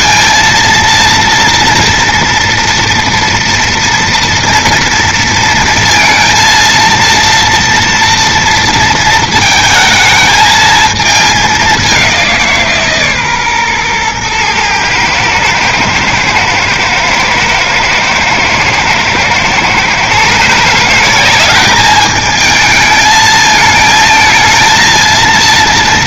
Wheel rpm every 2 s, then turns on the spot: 230, 230, 240, 230, 230, 220, 200, 120, 110, 110, 130, 210, 220.
none